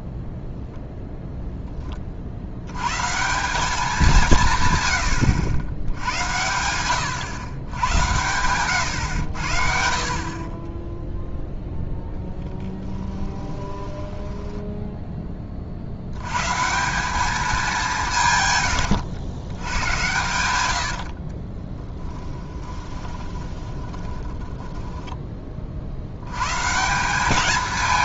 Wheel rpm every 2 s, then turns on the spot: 10, 100, 140, 100, 110, 20, 20, 10, 160, 120, 80, 20, 10, 140.
12-14 18-20 22-26